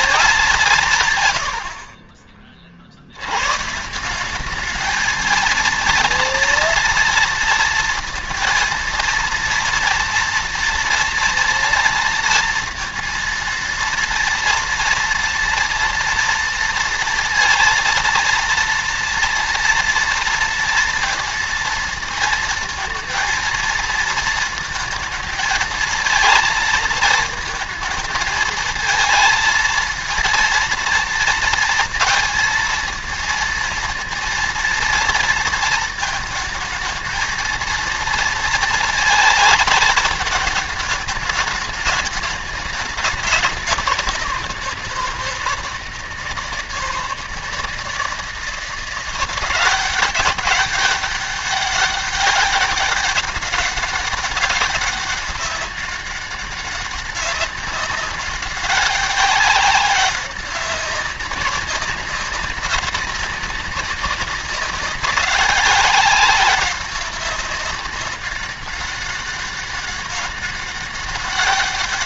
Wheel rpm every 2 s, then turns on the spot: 170, 40, 210, 230, 230, 230, 230, 230, 230, 230, 230, 230, 230, 230, 220, 230, 230, 230, 220, 230, 210, 210, 180, 160, 170, 200, 200, 200, 200, 200, 190, 200, 190, 200, 200, 200.
none